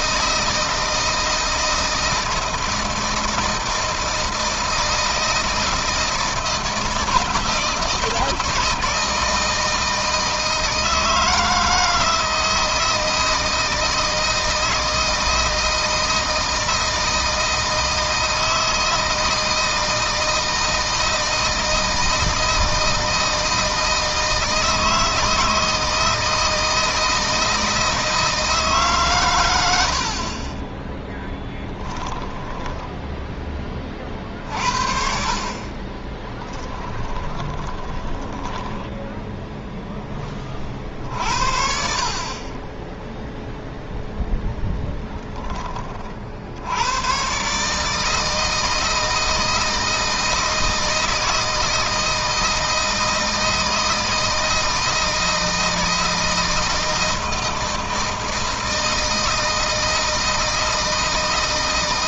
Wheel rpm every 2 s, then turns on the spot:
160, 160, 160, 170, 160, 160, 160, 160, 160, 160, 160, 160, 160, 160, 150, 20, 10, 50, 10, 10, 50, 20, 10, 90, 160, 160, 160, 160, 160, 160, 160.
32-34 36-40